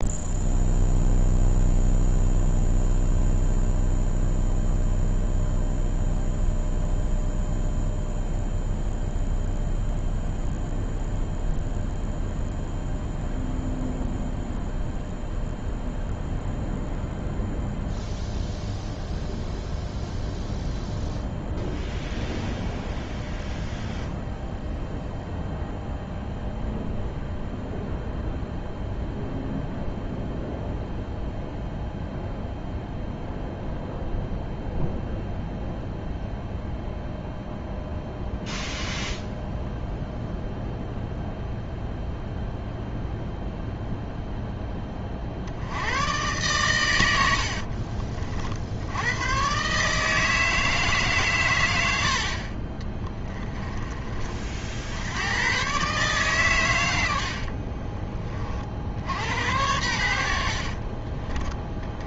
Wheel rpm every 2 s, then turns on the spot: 0, 0, 0, 0, 0, 0, 0, 0, 0, 0, 0, 0, 0, 0, 0, 0, 0, 0, 0, 0, 0, 0, 20, 100, 80, 160, 30, 70, 110, 70, 40.
52-54 60-62